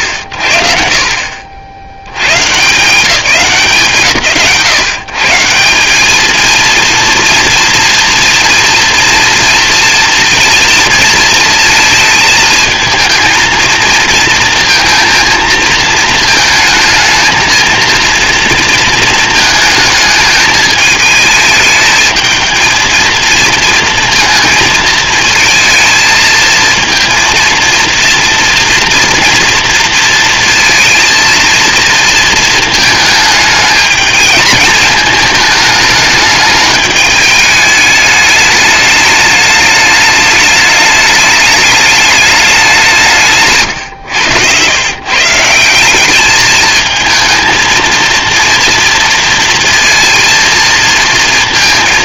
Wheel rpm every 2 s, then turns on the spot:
60, 160, 140, 230, 230, 230, 230, 230, 220, 230, 220, 220, 220, 230, 230, 230, 220, 220, 220, 210, 210, 170, 130, 220, 230, 230.
none